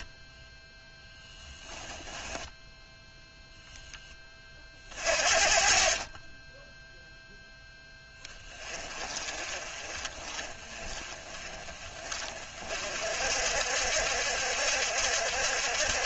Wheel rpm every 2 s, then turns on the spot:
10, 10, 40, 0, 30, 30, 50, 70.
0-2